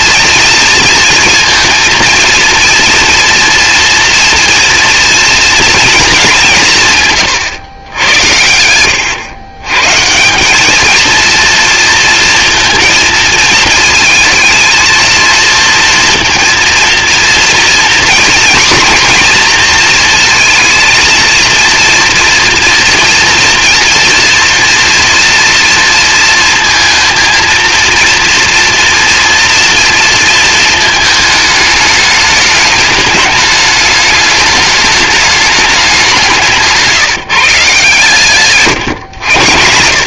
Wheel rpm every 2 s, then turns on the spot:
230, 230, 230, 180, 90, 200, 230, 220, 230, 240, 230, 230, 230, 230, 230, 220, 210, 210, 180, 130.
38-40